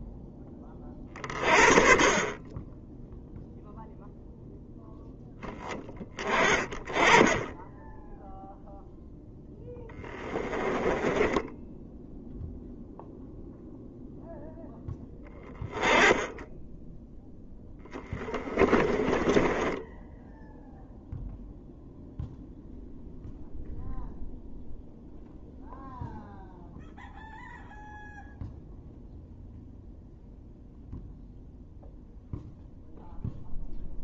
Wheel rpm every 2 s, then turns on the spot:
20, 20, 0, 20, 0, 10, 0, 0, 10, 10, 0, 0, 0, 0, 0, 0, 0.
10-12 18-20